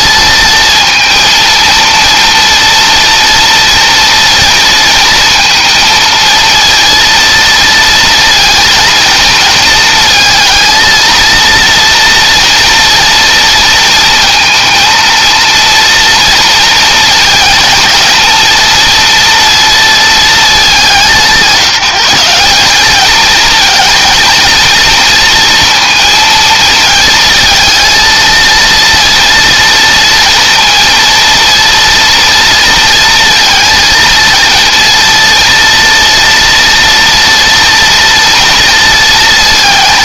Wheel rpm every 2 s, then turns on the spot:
230, 240, 230, 230, 230, 230, 230, 230, 230, 230, 180, 210, 230, 220, 230, 230, 230, 230, 230, 230.
none